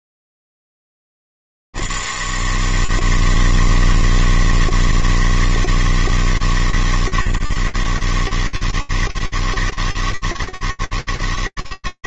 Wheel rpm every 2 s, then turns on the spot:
90, 160, 160, 150, 150, 160.
none